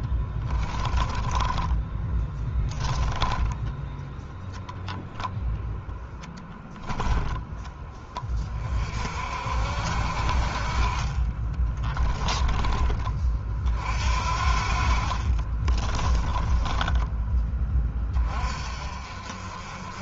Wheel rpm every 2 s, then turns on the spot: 10, 10, 0, 10, 50, 30, 30, 40, 20, 40.
0-4 14-18